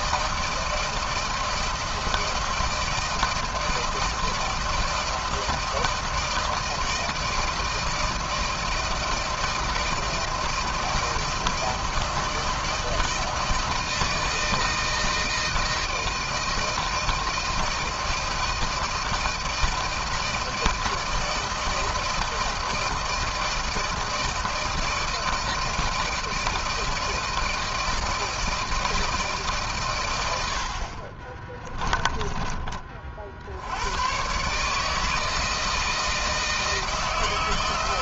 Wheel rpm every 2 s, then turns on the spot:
160, 160, 160, 160, 160, 160, 160, 160, 160, 160, 160, 160, 160, 160, 160, 100, 20, 120, 160.
32-34